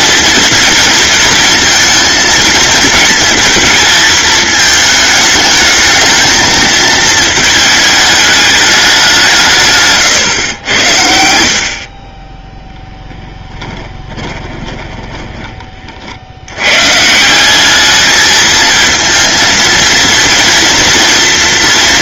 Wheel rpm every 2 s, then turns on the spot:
230, 220, 210, 220, 160, 70, 10, 20, 160, 230, 240.
12-16